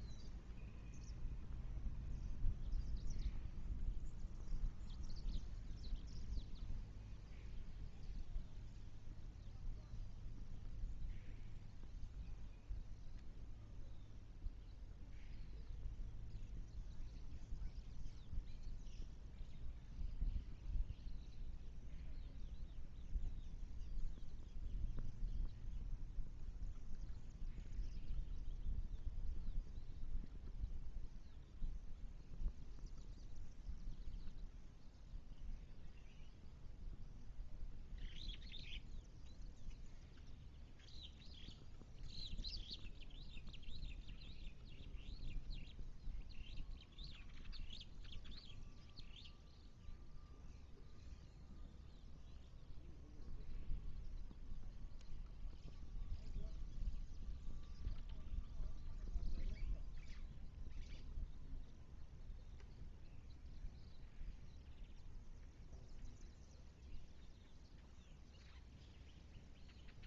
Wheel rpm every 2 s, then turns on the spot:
0, 0, 0, 0, 0, 0, 0, 0, 0, 0, 0, 0, 0, 0, 0, 0, 0, 0, 0, 0, 0, 0, 0, 0, 0, 0, 0, 0, 0, 0, 0, 0, 0, 0, 0.
none